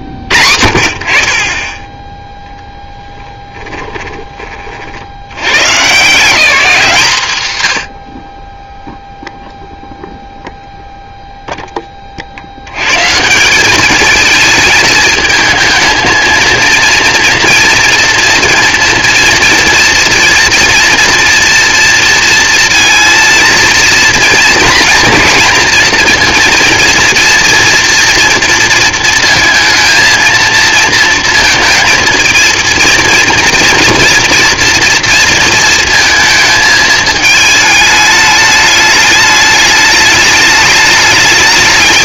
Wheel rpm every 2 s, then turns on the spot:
50, 0, 40, 200, 20, 0, 80, 220, 230, 230, 230, 230, 230, 230, 230, 230, 230, 230, 220, 210, 210.
none